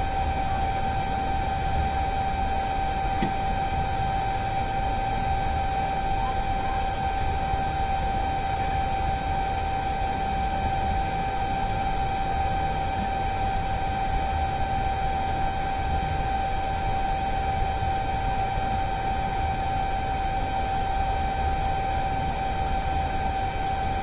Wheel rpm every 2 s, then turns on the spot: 0, 0, 0, 0, 0, 0, 0, 0, 0, 0, 0, 0.
none